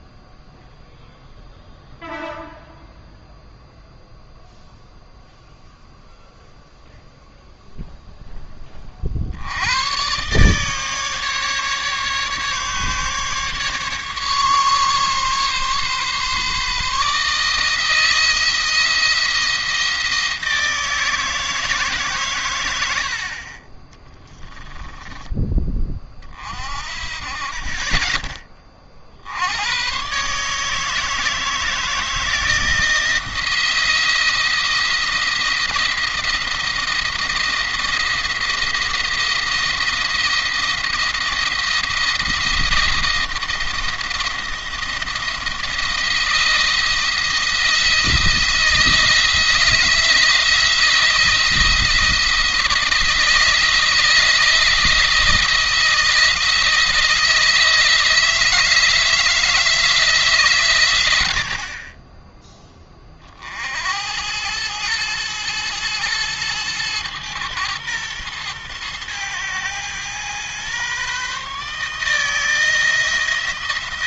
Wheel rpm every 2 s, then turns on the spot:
0, 0, 0, 0, 20, 140, 140, 140, 150, 170, 160, 100, 10, 40, 30, 150, 160, 170, 170, 170, 170, 170, 170, 170, 160, 160, 160, 160, 160, 160, 130, 10, 100, 110, 110, 120, 160.
24-26